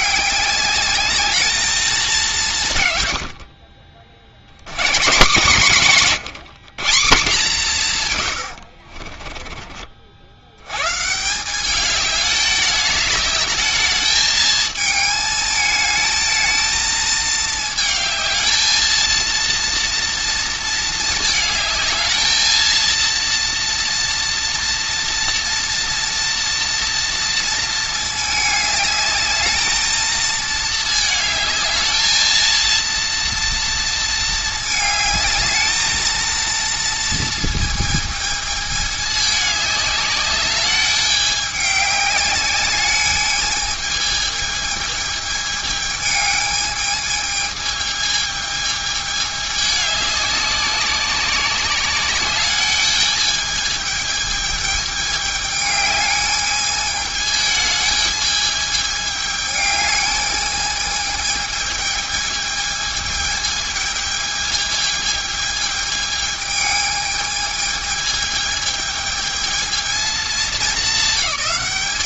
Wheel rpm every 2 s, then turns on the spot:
210, 140, 140, 170, 50, 130, 210, 220, 220, 230, 220, 230, 240, 230, 210, 220, 230, 220, 230, 210, 200, 210, 220, 220, 210, 190, 210, 210, 210, 210, 210, 220, 220, 220, 220, 220.
8-10